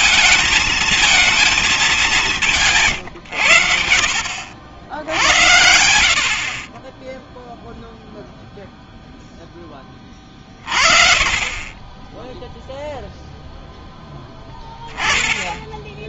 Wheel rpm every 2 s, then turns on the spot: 220, 170, 70, 50, 0, 30, 0, 10.
none